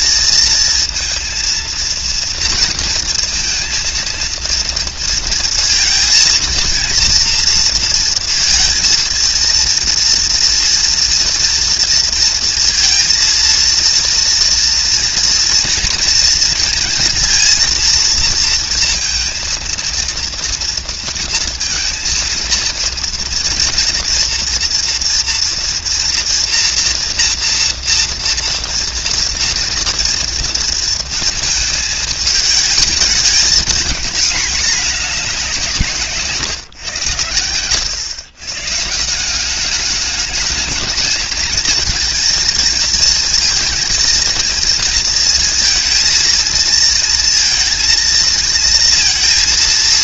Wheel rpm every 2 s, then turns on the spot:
230, 230, 230, 230, 230, 230, 230, 230, 230, 230, 230, 230, 230, 240, 230, 230, 220, 220, 120, 140, 220, 220, 230, 220, 230.
none